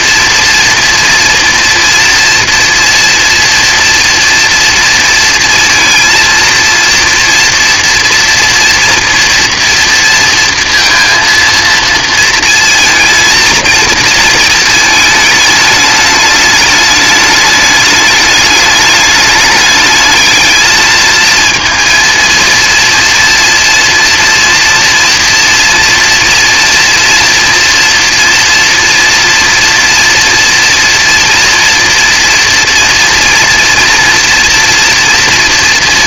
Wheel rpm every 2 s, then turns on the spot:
230, 240, 230, 230, 230, 230, 230, 230, 210, 210, 210, 230, 230, 230, 230, 240, 230, 230.
none